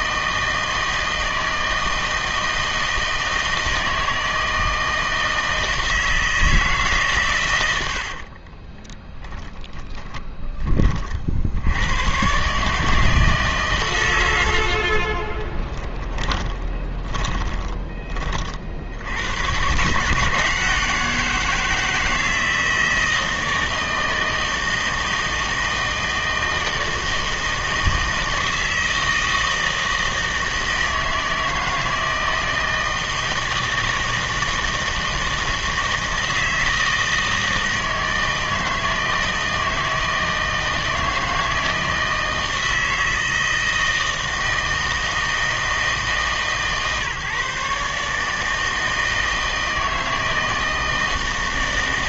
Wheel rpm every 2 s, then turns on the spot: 160, 160, 160, 140, 20, 40, 160, 40, 20, 80, 170, 160, 160, 160, 160, 160, 160, 160, 160, 160, 160, 160, 160, 150, 160, 160.
8-10 14-18